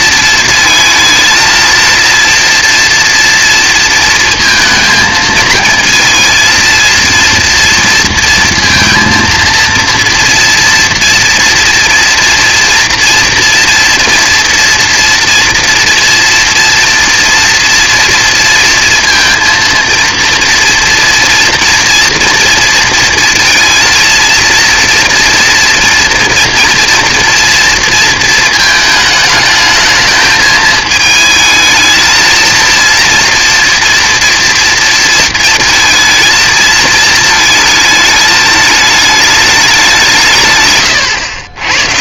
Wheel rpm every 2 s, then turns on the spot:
230, 230, 230, 230, 230, 230, 230, 230, 230, 230, 230, 230, 230, 230, 220, 220, 230, 230, 220, 220, 130.
none